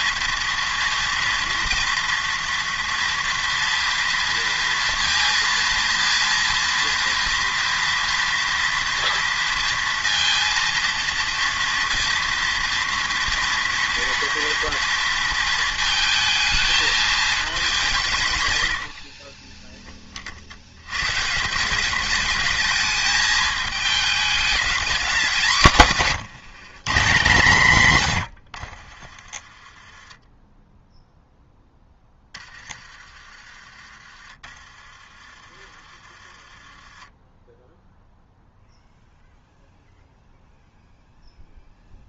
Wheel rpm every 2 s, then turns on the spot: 230, 230, 230, 230, 230, 230, 230, 230, 220, 110, 90, 220, 220, 190, 60, 10, 20, 30, 30, 0, 0.
none